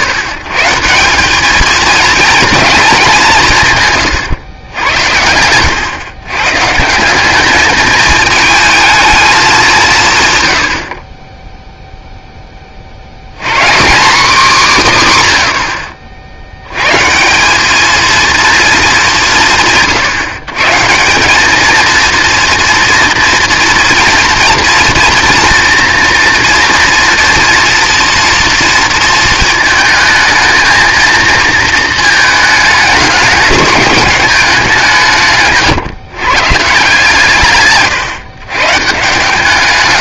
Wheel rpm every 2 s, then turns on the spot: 130, 230, 110, 140, 220, 90, 20, 210, 90, 230, 150, 230, 240, 230, 230, 220, 210, 180, 150, 140.
none